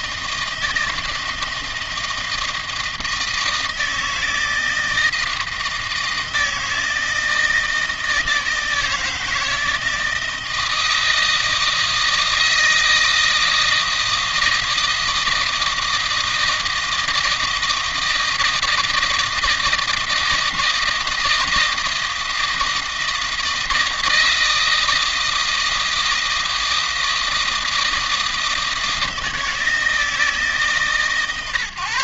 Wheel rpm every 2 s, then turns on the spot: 160, 160, 160, 160, 160, 160, 160, 160, 160, 160, 160, 160, 160, 160, 160, 150.
none